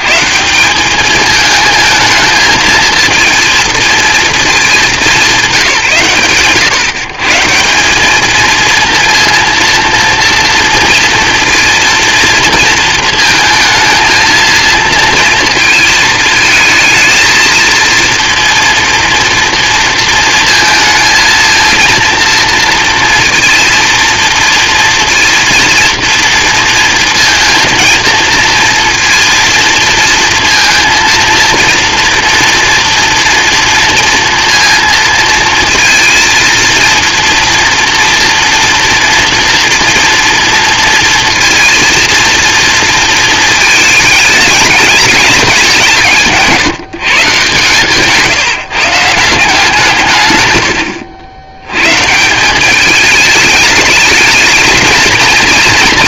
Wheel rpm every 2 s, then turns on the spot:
130, 220, 230, 120, 200, 230, 230, 220, 220, 230, 230, 230, 230, 230, 230, 230, 230, 230, 230, 230, 230, 230, 210, 180, 150, 140, 170, 220.
none